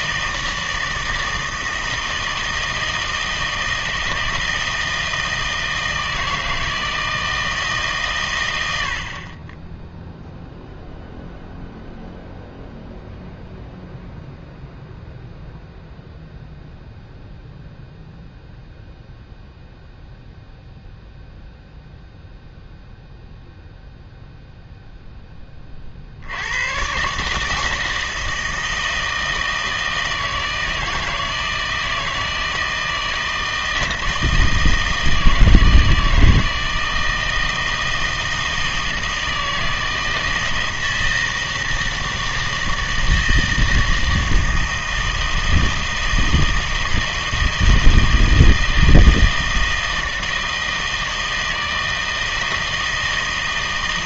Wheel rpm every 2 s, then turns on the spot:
160, 160, 160, 160, 90, 0, 0, 0, 0, 0, 0, 0, 0, 110, 160, 160, 160, 160, 160, 160, 160, 160, 160, 160, 160, 160, 160.
none